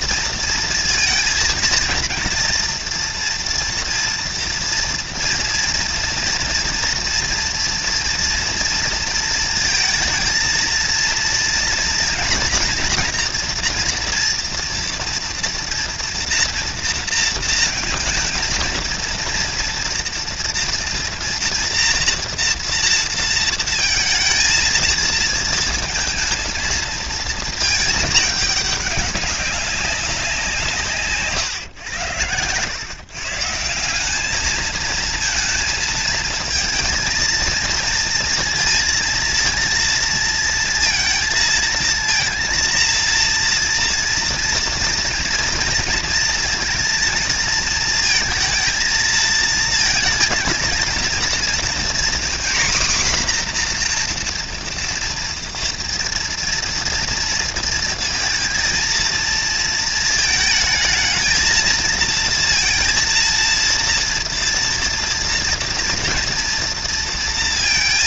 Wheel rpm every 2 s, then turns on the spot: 230, 240, 240, 230, 230, 230, 230, 230, 230, 230, 230, 230, 230, 230, 200, 160, 120, 220, 230, 230, 230, 230, 230, 230, 220, 230, 260, 230, 230, 230, 220, 230, 230, 230.
none